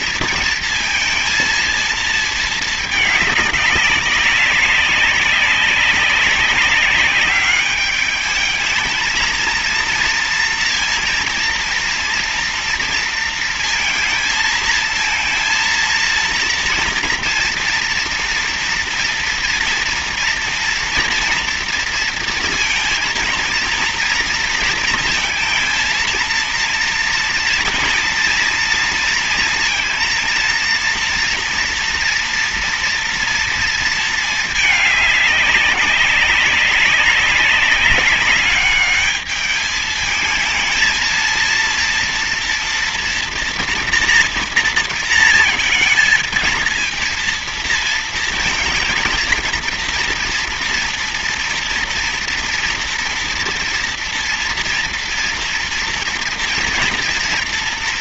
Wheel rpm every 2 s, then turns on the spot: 230, 220, 190, 190, 210, 230, 230, 230, 240, 230, 240, 230, 230, 230, 230, 230, 240, 210, 190, 200, 220, 240, 230, 230, 230, 230, 230, 230, 230.
none